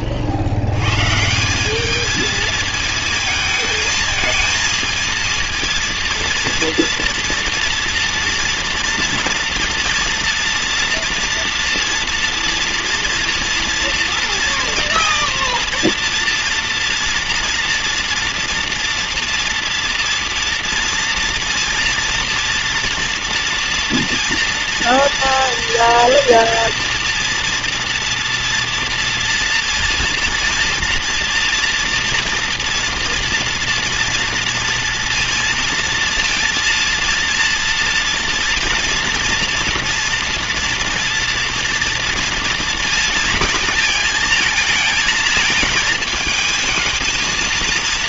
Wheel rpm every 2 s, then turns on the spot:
120, 220, 230, 230, 230, 230, 230, 230, 230, 230, 230, 230, 230, 240, 230, 230, 240, 230, 230, 240, 230, 220, 220, 220.
none